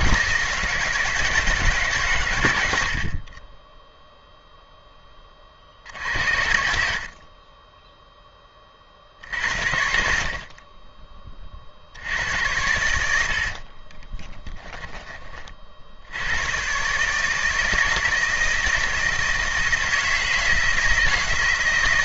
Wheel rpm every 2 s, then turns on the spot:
150, 90, 0, 60, 30, 40, 90, 10, 130, 160, 160.
6-8